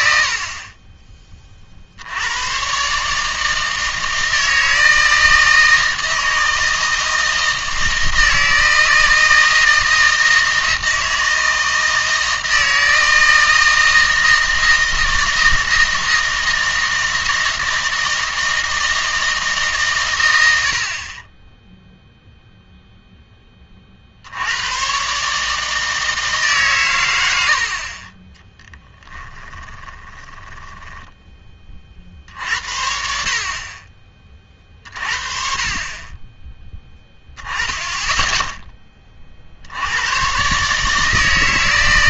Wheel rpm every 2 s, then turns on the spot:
40, 130, 160, 160, 160, 160, 160, 160, 160, 160, 70, 0, 110, 130, 10, 10, 60, 40, 10, 10, 140.
28-32